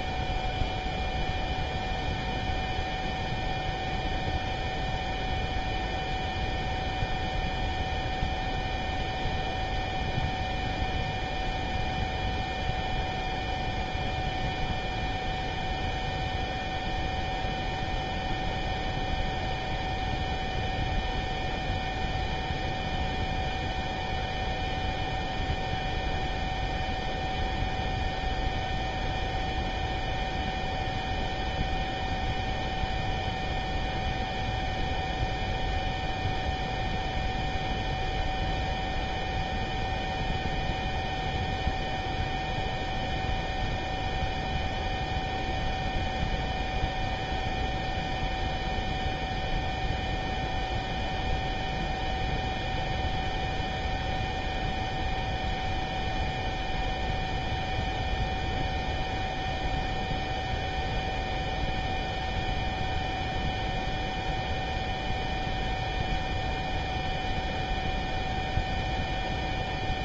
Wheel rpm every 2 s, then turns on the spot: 0, 0, 0, 0, 0, 0, 0, 0, 0, 0, 0, 0, 0, 0, 0, 0, 0, 0, 0, 0, 0, 0, 0, 0, 0, 0, 0, 0, 0, 0, 0, 0, 0, 0, 0.
none